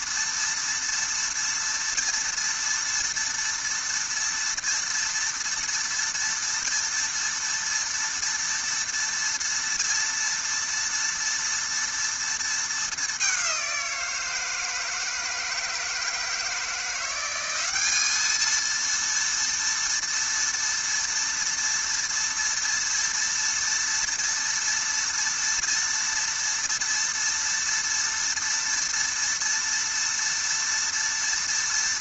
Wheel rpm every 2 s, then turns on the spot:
230, 230, 230, 230, 230, 230, 210, 160, 170, 230, 230, 230, 230, 230, 230, 230.
none